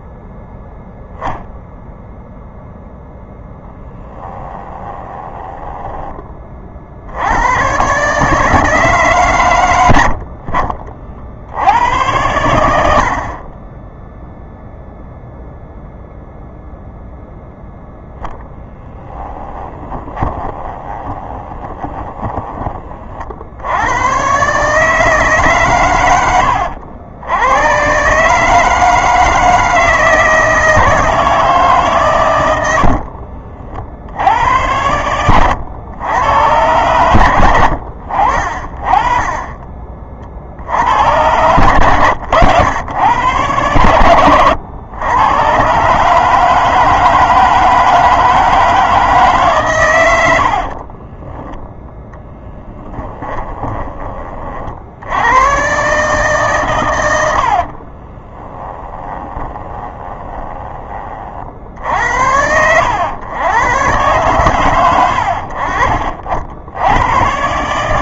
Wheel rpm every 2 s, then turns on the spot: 0, 0, 10, 60, 150, 50, 80, 0, 0, 10, 20, 30, 150, 90, 160, 160, 80, 90, 120, 30, 100, 110, 110, 160, 160, 30, 10, 50, 110, 20, 20, 90, 100, 90.
4-6 18-22 32-34 50-54 58-60